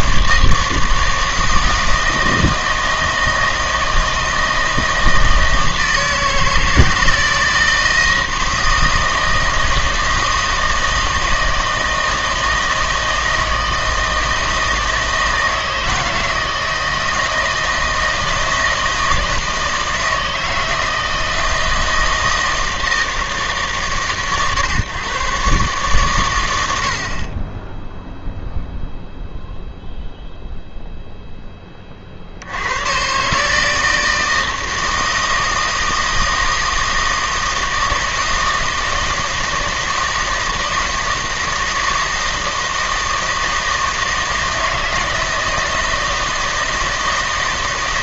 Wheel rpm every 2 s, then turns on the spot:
160, 160, 160, 160, 160, 160, 160, 160, 160, 160, 160, 160, 130, 70, 0, 0, 110, 160, 160, 160, 160, 160, 160, 160.
none